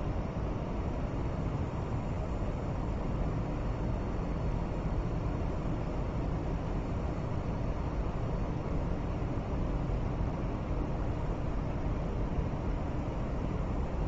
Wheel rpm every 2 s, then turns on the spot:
0, 0, 0, 0, 0, 0, 0.
none